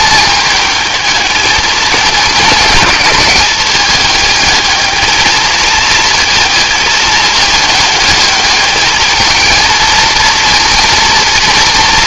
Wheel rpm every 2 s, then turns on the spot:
220, 200, 220, 220, 210, 230.
none